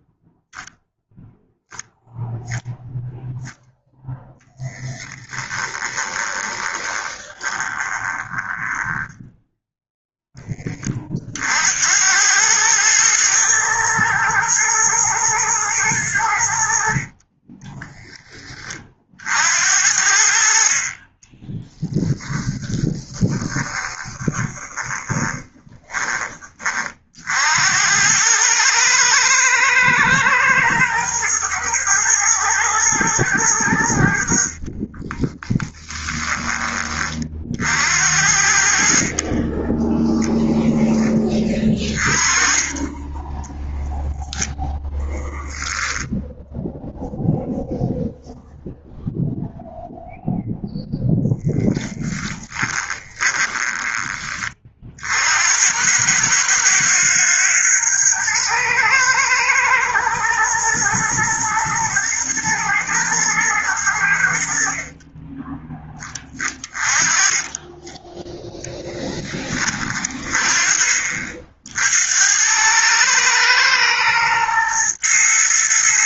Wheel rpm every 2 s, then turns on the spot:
0, 0, 10, 20, 10, 40, 110, 110, 40, 40, 30, 20, 20, 50, 110, 110, 110, 30, 30, 50, 10, 20, 10, 0, 0, 0, 20, 50, 110, 120, 110, 110, 40, 20, 10, 40, 110, 120.
4-10 22-26 34-36 52-54